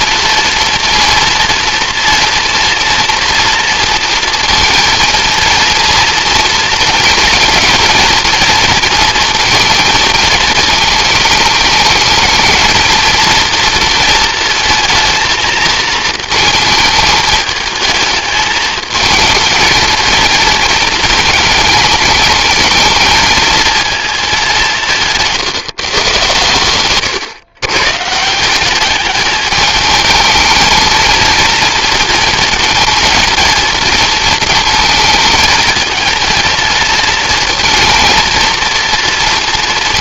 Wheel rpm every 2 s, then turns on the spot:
240, 230, 230, 220, 230, 220, 230, 220, 220, 220, 220, 230, 150, 130, 210, 230, 230, 220, 230, 230.
none